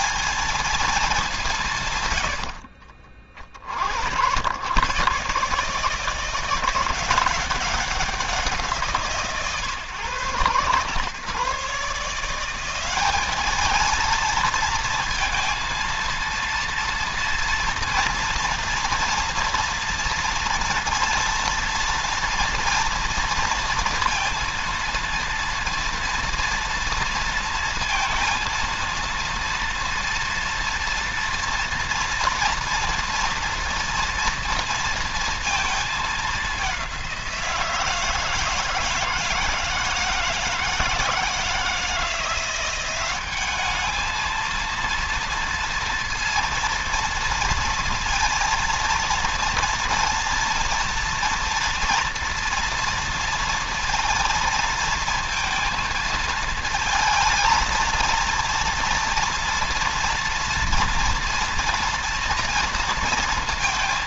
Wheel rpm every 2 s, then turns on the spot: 210, 60, 120, 180, 170, 110, 190, 230, 230, 230, 230, 230, 230, 230, 230, 230, 230, 230, 190, 160, 160, 180, 230, 230, 230, 230, 230, 230, 230, 230, 230, 230.
none